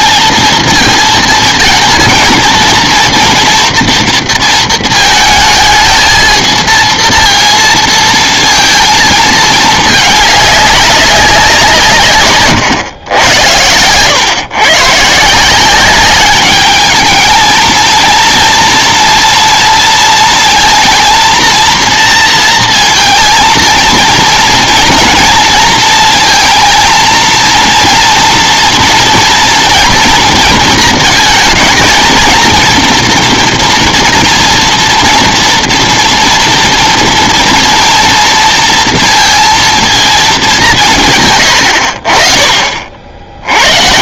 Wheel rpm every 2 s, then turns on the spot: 230, 230, 220, 230, 230, 200, 110, 130, 210, 230, 230, 230, 230, 230, 230, 220, 240, 240, 230, 230, 190, 40.
none